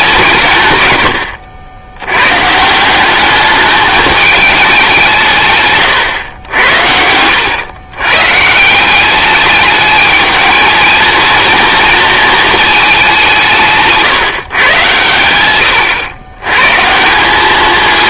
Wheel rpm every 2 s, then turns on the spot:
140, 160, 200, 90, 160, 220, 220, 120, 130.
none